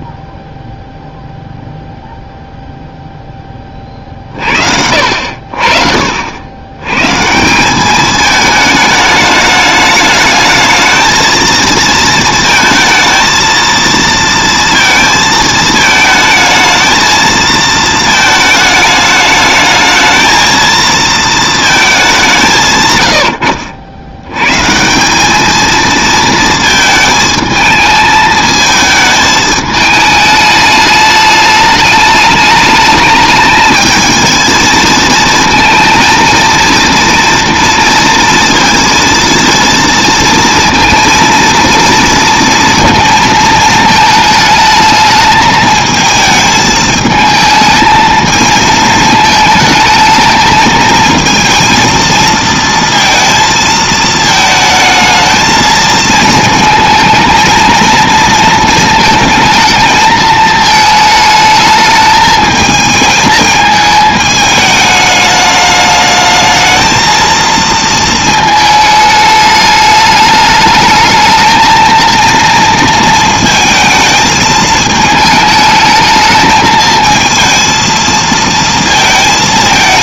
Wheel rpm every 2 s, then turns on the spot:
0, 0, 60, 120, 220, 220, 220, 230, 220, 220, 230, 150, 140, 220, 220, 210, 210, 220, 230, 230, 230, 230, 220, 220, 220, 220, 230, 220, 220, 230, 220, 220, 210, 220, 220, 210, 230, 220, 220, 230.
none